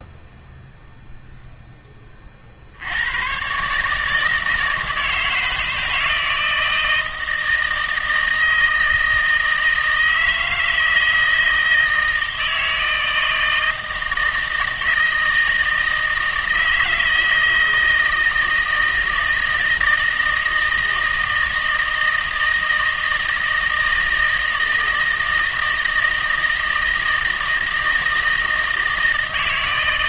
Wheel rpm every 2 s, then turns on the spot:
0, 70, 160, 160, 160, 160, 160, 160, 160, 160, 160, 160, 160, 160, 160.
none